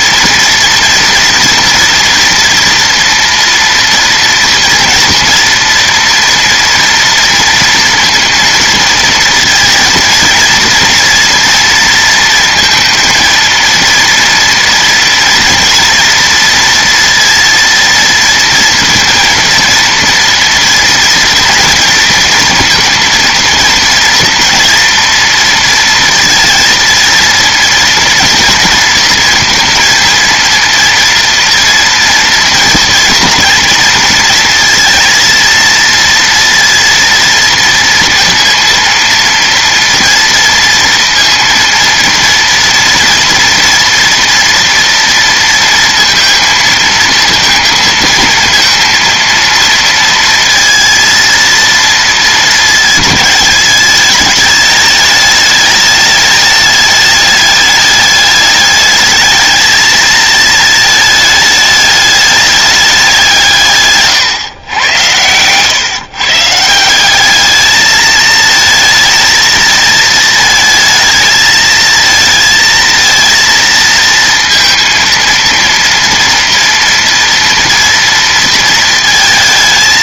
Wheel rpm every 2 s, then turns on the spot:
230, 230, 230, 230, 230, 230, 230, 230, 230, 230, 230, 230, 230, 230, 230, 230, 230, 230, 230, 230, 230, 240, 230, 230, 230, 230, 210, 210, 210, 210, 220, 200, 110, 170, 220, 220, 230, 230, 230, 230.
none